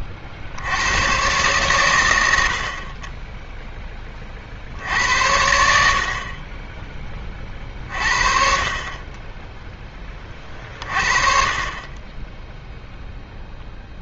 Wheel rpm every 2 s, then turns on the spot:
80, 60, 60, 20, 40, 30, 0.
none